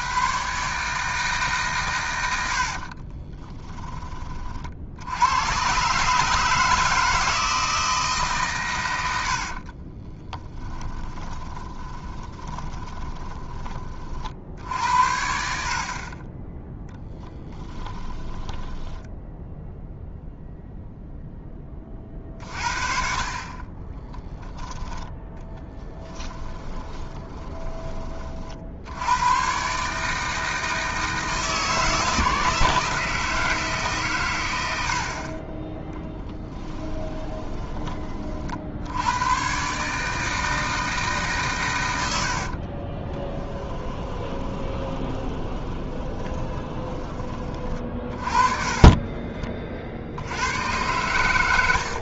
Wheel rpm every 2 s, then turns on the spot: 140, 60, 50, 160, 100, 10, 20, 70, 10, 10, 0, 40, 10, 20, 60, 160, 160, 70, 10, 60, 160, 30, 20, 20, 30, 100.
2-4 10-14 18-20 26-28 36-38 42-46 48-50